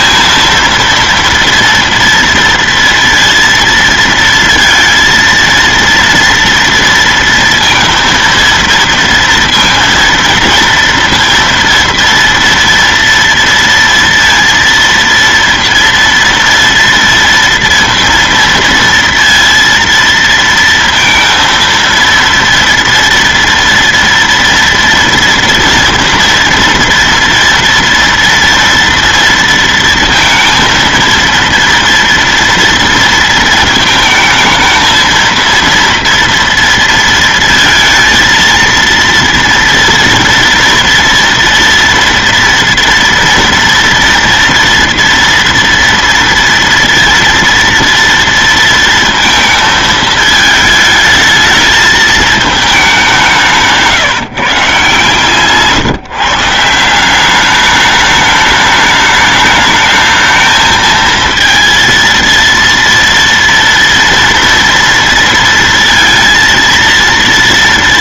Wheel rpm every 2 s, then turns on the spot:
230, 230, 230, 230, 230, 230, 230, 230, 230, 230, 230, 230, 230, 230, 230, 230, 230, 220, 230, 230, 230, 230, 230, 230, 230, 220, 210, 140, 150, 210, 220, 230, 230, 230.
none